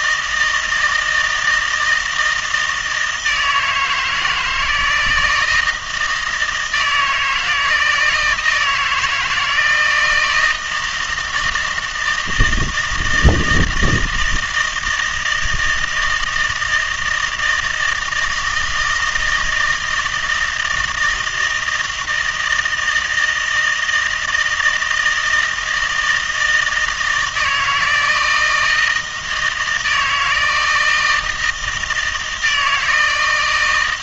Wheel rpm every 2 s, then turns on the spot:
160, 160, 160, 160, 160, 170, 160, 160, 160, 160, 160, 160, 160, 160, 160, 160, 160.
none